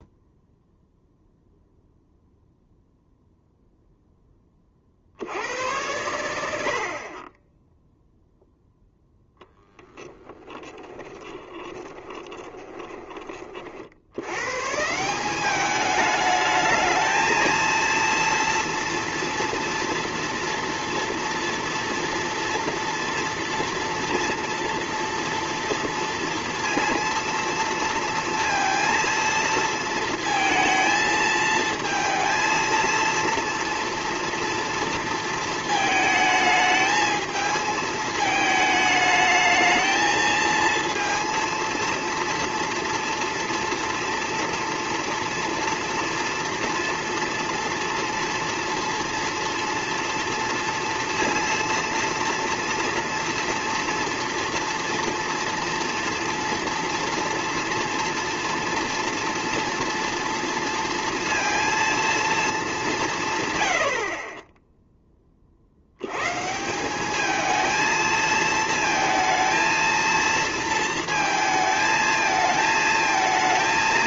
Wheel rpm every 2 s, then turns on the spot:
0, 0, 30, 70, 10, 20, 20, 140, 210, 230, 230, 230, 230, 230, 230, 230, 230, 230, 220, 220, 230, 230, 230, 230, 230, 230, 230, 230, 230, 230, 230, 200, 10, 170, 220, 230, 220.
10-14